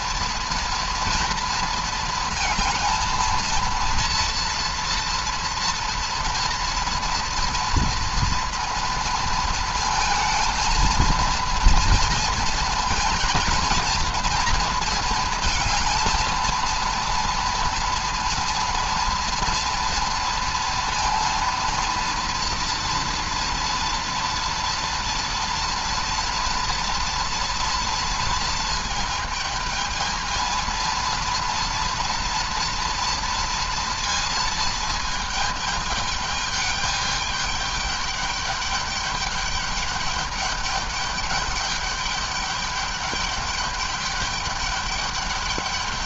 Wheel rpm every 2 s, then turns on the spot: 230, 220, 230, 230, 230, 230, 230, 230, 230, 240, 230, 240, 230, 230, 230, 230, 230, 220, 210, 200, 200, 200, 210.
none